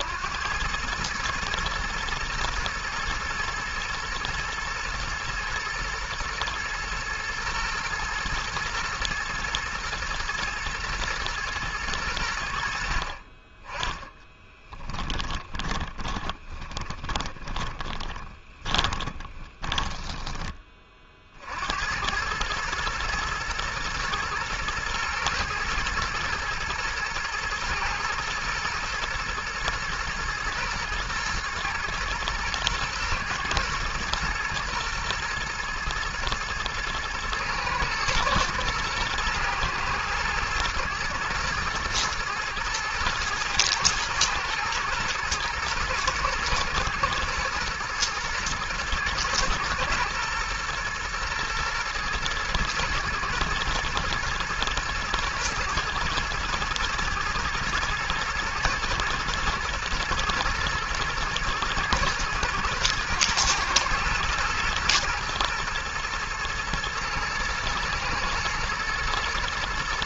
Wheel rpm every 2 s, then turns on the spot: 90, 120, 110, 110, 110, 110, 70, 10, 20, 10, 20, 110, 120, 120, 120, 120, 120, 120, 110, 120, 110, 120, 110, 120, 110, 120, 120, 110, 110, 120, 110, 110, 110, 120, 110.
14-20